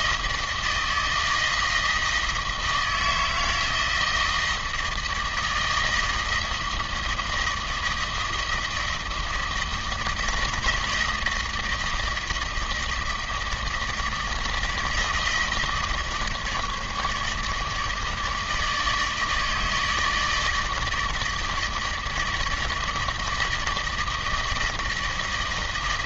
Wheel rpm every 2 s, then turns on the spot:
160, 160, 160, 160, 160, 160, 160, 160, 150, 160, 160, 160, 160.
none